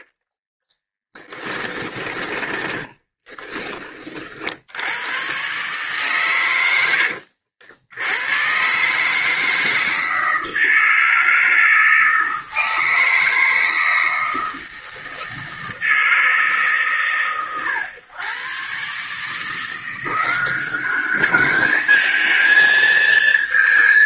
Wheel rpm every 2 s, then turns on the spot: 20, 10, 100, 90, 140, 160, 160, 160, 130, 150, 200, 230.
0-4